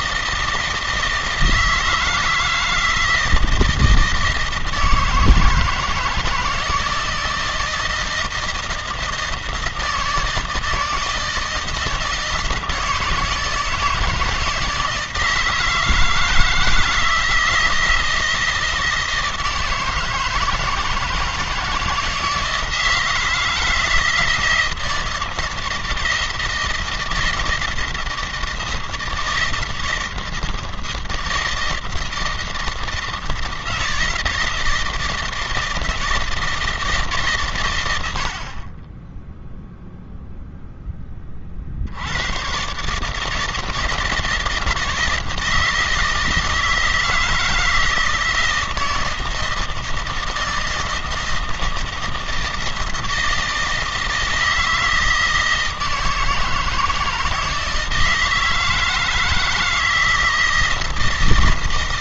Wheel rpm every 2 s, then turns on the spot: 160, 160, 160, 160, 160, 160, 160, 170, 160, 160, 160, 160, 160, 160, 160, 160, 160, 160, 160, 50, 0, 120, 160, 160, 170, 160, 160, 160, 160, 160, 160.
none